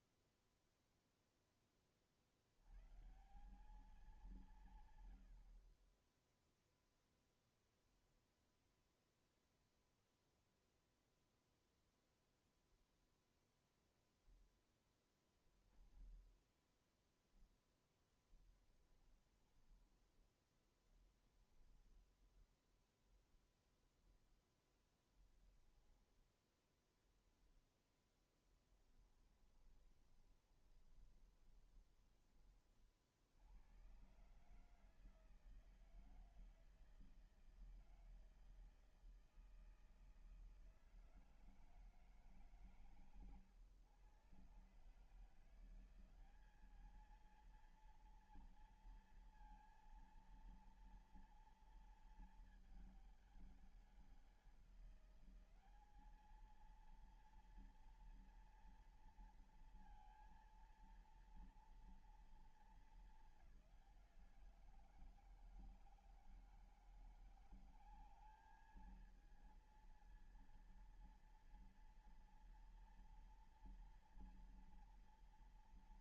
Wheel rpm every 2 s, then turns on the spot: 0, 50, 200, 20, 0, 0, 0, 0, 0, 20, 10, 20, 10, 10, 0, 20, 20, 120, 160, 160, 160, 150, 130, 190, 230, 230, 220, 190, 210, 230, 230, 220, 170, 160, 200, 230, 230, 230.
18-22 26-28 30-32